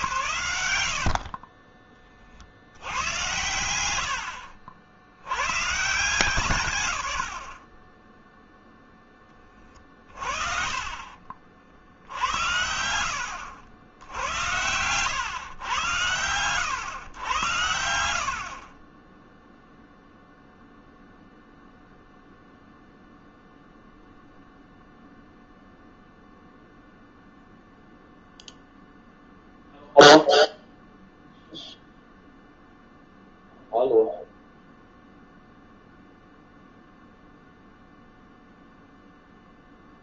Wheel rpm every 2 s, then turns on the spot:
70, 100, 70, 110, 10, 30, 90, 100, 110, 30, 0, 0, 0, 0, 0, 0, 0, 0, 0, 0.
0-2 10-12